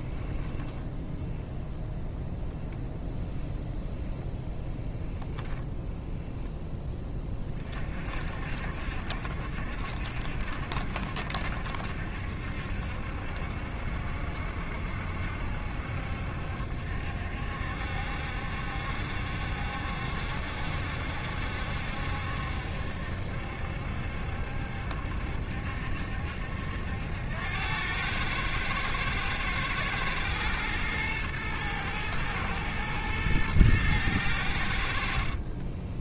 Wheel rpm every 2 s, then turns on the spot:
10, 0, 10, 10, 60, 70, 70, 70, 70, 70, 70, 70, 70, 80, 110, 110, 110, 70.
0-2